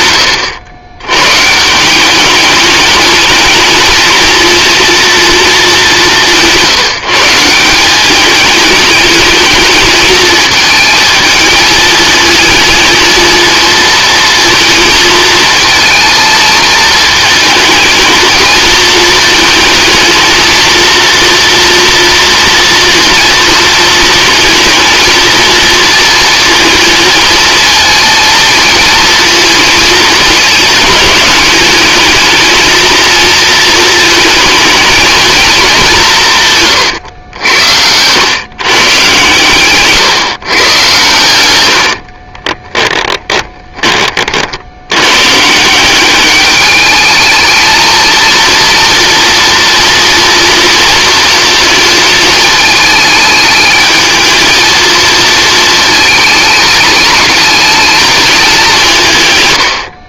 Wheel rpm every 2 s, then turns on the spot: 90, 220, 230, 160, 210, 220, 230, 220, 220, 220, 230, 230, 230, 230, 230, 210, 230, 220, 100, 130, 120, 20, 120, 220, 230, 230, 220, 230, 220, 140.
42-44